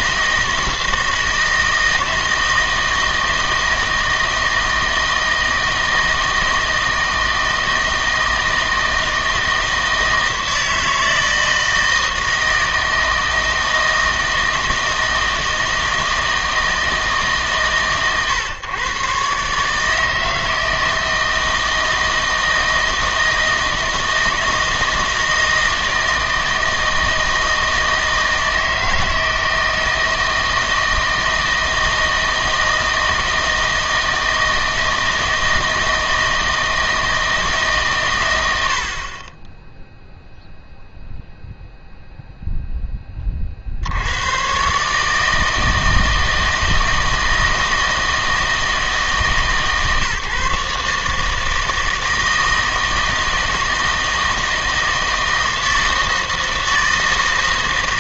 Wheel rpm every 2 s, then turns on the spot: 160, 160, 160, 160, 160, 160, 160, 160, 160, 120, 160, 160, 160, 160, 160, 160, 160, 160, 160, 80, 0, 0, 140, 160, 160, 140, 160, 160, 160.
none